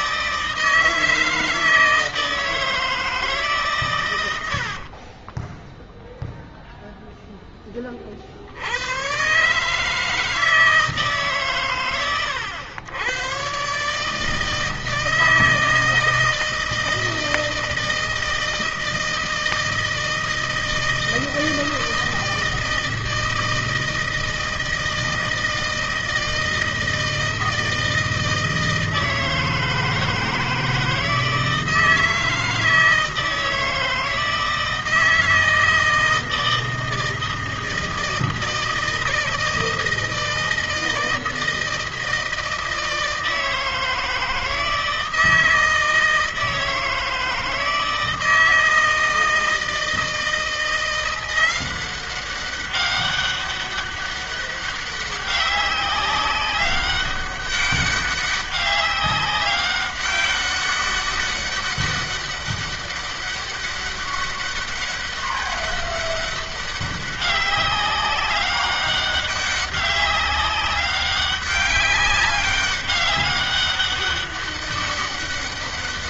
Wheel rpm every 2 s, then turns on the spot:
160, 160, 90, 0, 70, 160, 100, 160, 160, 160, 160, 160, 160, 160, 160, 160, 160, 160, 160, 160, 160, 160, 160, 160, 160, 170, 190, 200, 200, 200, 200, 200, 200, 200, 200, 190, 200, 200.
4-6